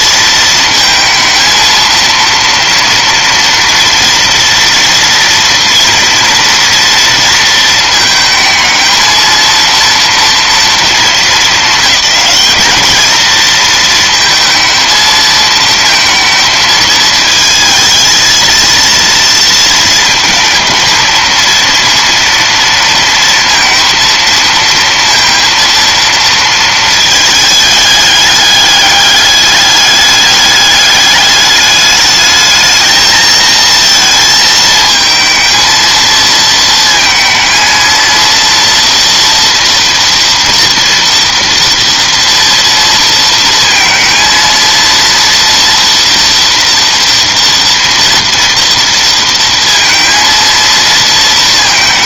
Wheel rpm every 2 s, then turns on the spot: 230, 230, 230, 220, 230, 210, 230, 220, 220, 220, 230, 230, 230, 210, 210, 210, 230, 230, 230, 230, 230, 230, 230, 230, 230, 230.
none